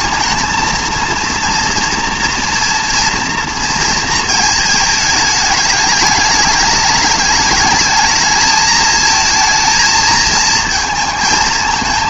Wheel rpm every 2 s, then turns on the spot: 220, 230, 220, 210, 220, 230.
none